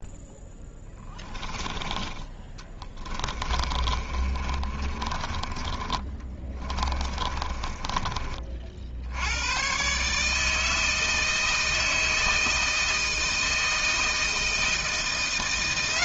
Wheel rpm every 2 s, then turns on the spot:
10, 20, 20, 20, 60, 160, 160, 170.
0-8